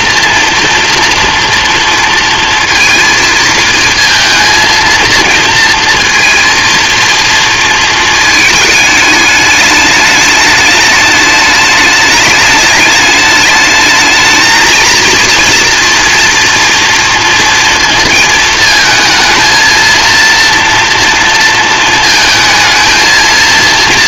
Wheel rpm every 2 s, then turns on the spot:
230, 230, 230, 230, 210, 210, 210, 230, 230, 220, 230, 220.
none